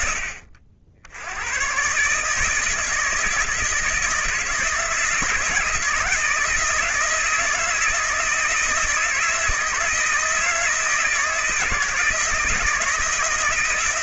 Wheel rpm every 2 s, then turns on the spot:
70, 160, 160, 160, 160, 160, 170.
none